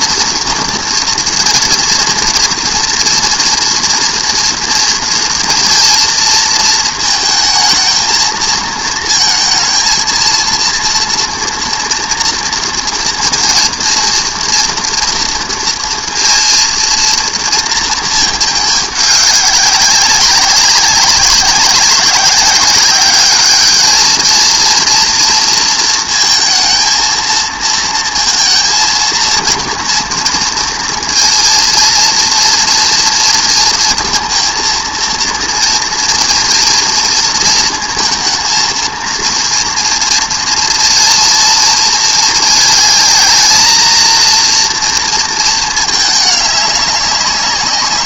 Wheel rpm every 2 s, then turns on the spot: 230, 240, 230, 230, 220, 230, 230, 230, 230, 210, 200, 200, 230, 230, 230, 230, 230, 230, 230, 230, 230, 220, 230, 200.
none